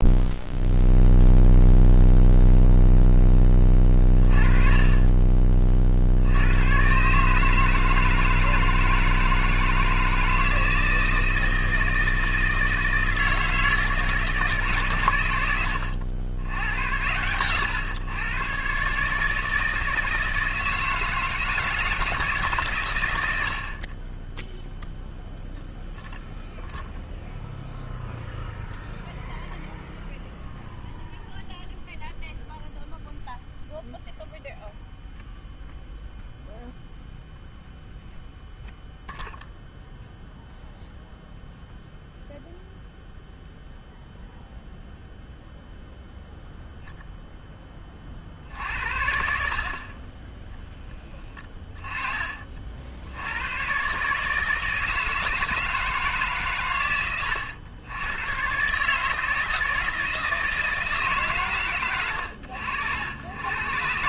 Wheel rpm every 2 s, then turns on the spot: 0, 0, 40, 100, 160, 160, 160, 140, 90, 140, 160, 130, 0, 0, 0, 0, 0, 0, 0, 0, 0, 0, 0, 10, 70, 10, 50, 160, 120, 140, 160, 80.
none